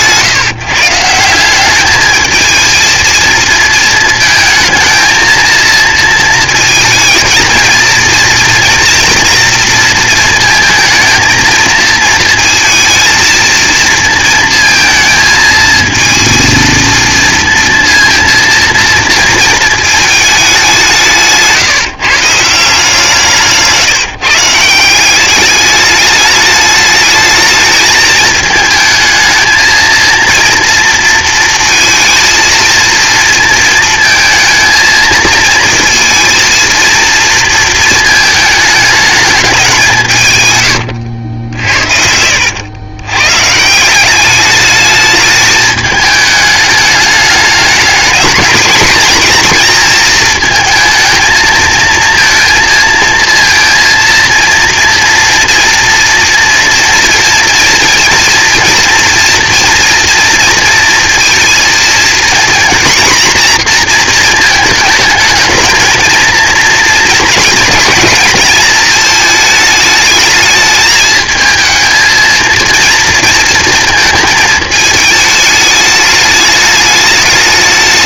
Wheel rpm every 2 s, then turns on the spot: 150, 230, 220, 220, 230, 230, 230, 230, 230, 230, 190, 160, 170, 210, 220, 230, 230, 220, 230, 220, 100, 100, 210, 210, 230, 220, 230, 230, 230, 230, 230, 240, 220, 230, 220, 220, 230, 220, 210.
40-42